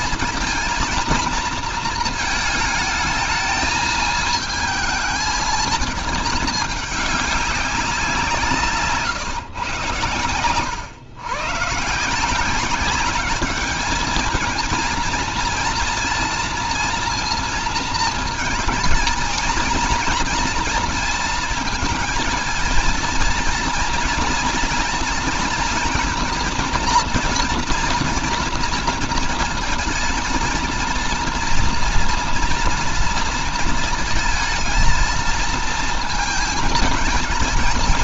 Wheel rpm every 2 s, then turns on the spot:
230, 220, 220, 210, 160, 120, 190, 230, 230, 230, 230, 230, 230, 240, 230, 230, 240, 230, 220.
none